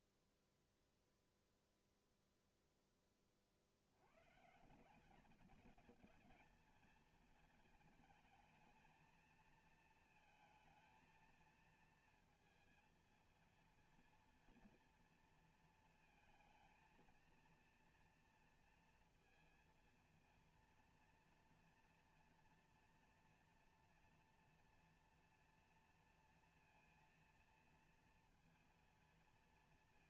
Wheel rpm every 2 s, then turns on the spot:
0, 0, 160, 220, 220, 220, 220, 230, 230, 230, 230, 230, 230, 230, 230.
none